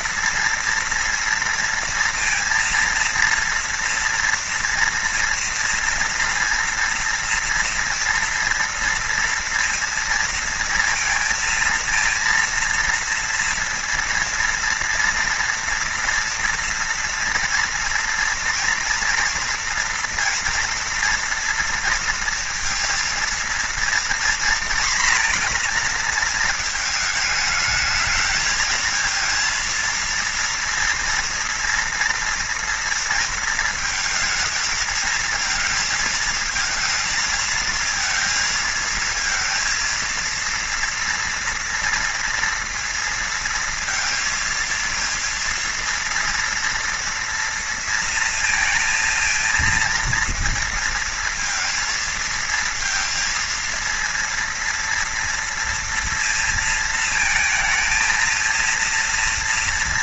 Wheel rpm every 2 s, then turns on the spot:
230, 230, 240, 230, 230, 230, 230, 230, 240, 230, 230, 230, 240, 220, 220, 230, 230, 230, 230, 230, 230, 230, 230, 230, 230, 230, 230, 230, 230, 230.
none